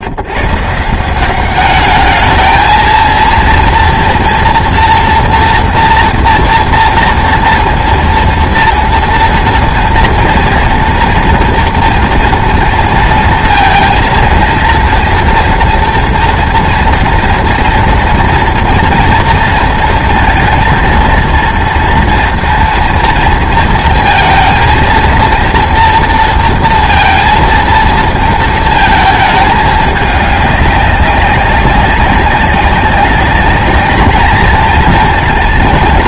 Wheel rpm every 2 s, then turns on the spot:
150, 220, 230, 230, 230, 230, 230, 230, 230, 230, 230, 230, 230, 230, 220, 200, 200, 220.
none